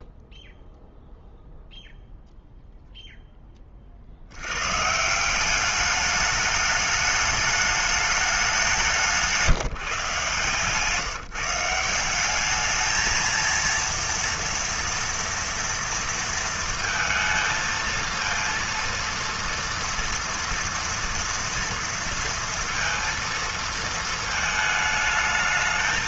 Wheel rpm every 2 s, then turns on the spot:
0, 0, 90, 210, 190, 150, 200, 230, 230, 230, 230, 230, 220.
none